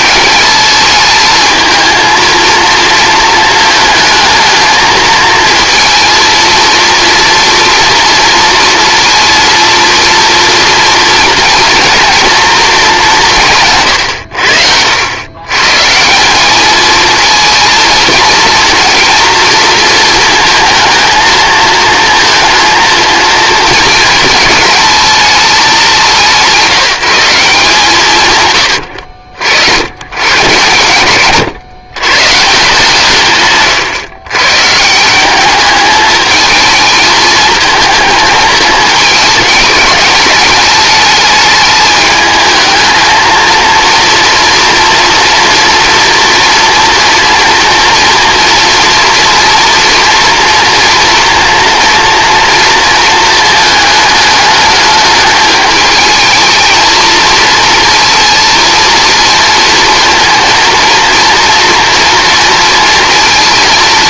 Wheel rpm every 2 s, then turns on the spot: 210, 230, 220, 230, 230, 230, 220, 90, 210, 230, 230, 230, 220, 170, 100, 110, 150, 140, 220, 220, 210, 220, 230, 230, 230, 230, 230, 210, 220, 230, 230, 230.
none